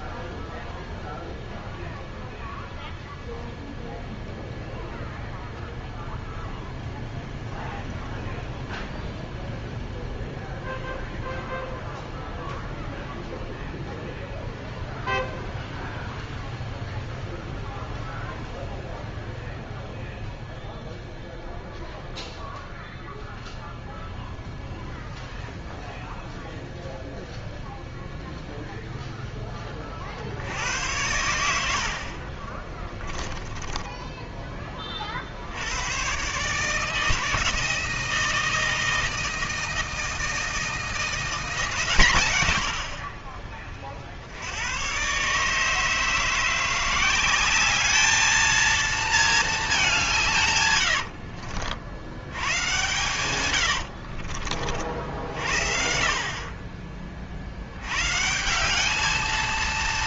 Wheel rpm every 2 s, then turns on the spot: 0, 0, 0, 0, 0, 0, 0, 0, 0, 0, 0, 0, 0, 0, 0, 80, 20, 30, 150, 160, 160, 70, 100, 170, 220, 120, 100, 60, 30, 180.
32-34 50-54